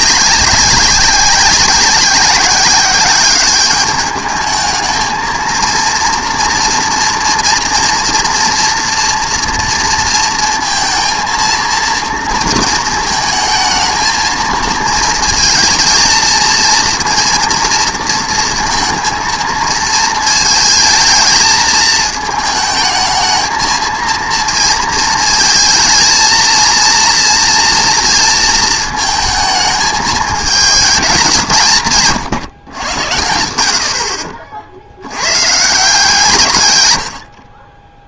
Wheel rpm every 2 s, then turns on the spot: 190, 190, 220, 230, 230, 230, 230, 230, 230, 230, 220, 220, 220, 230, 230, 220, 130, 60, 140.
none